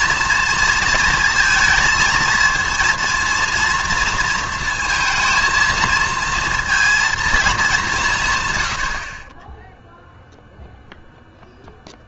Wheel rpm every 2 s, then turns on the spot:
230, 230, 230, 230, 110, 0.
none